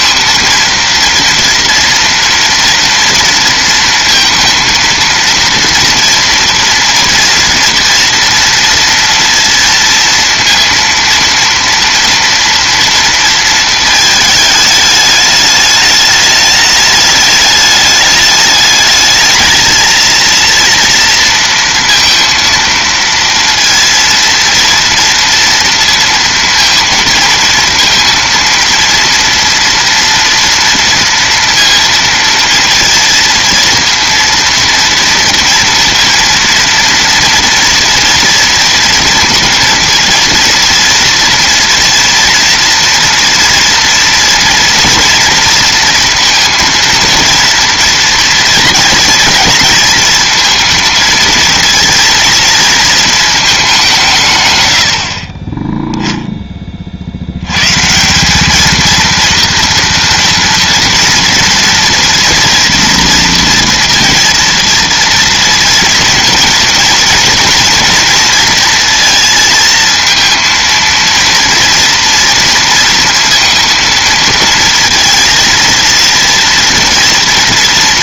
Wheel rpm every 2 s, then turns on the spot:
230, 230, 230, 240, 230, 230, 230, 210, 210, 210, 230, 230, 230, 230, 230, 230, 230, 230, 230, 230, 230, 230, 230, 230, 230, 230, 230, 90, 30, 220, 230, 230, 230, 230, 230, 230, 230, 230, 230.
none